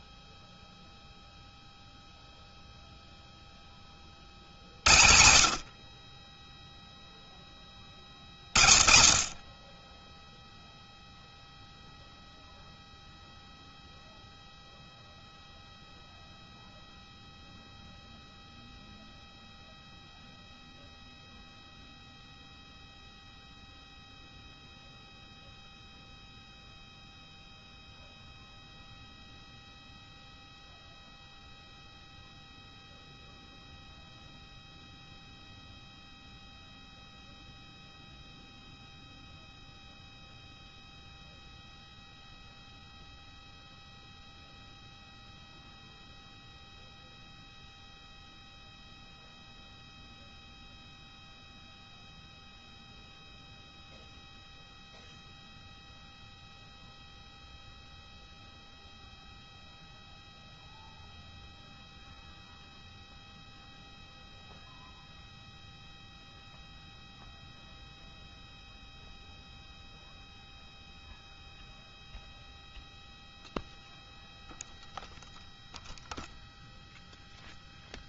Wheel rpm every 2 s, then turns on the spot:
0, 0, 80, 10, 40, 0, 0, 0, 0, 0, 0, 0, 0, 0, 0, 0, 0, 0, 0, 0, 0, 0, 0, 0, 0, 0, 0, 0, 0, 0, 0, 0, 0, 0, 0, 0, 0, 0, 0.
none